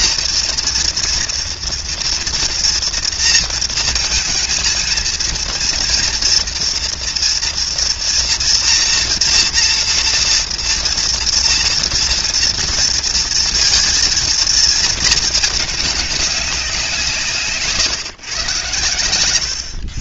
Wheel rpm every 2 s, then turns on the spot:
230, 230, 220, 240, 230, 230, 230, 230, 190, 120.
none